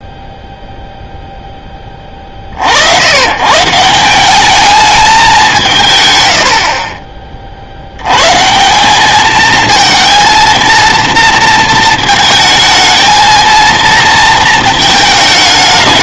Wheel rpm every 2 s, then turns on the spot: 0, 60, 210, 40, 170, 230, 220, 230.
none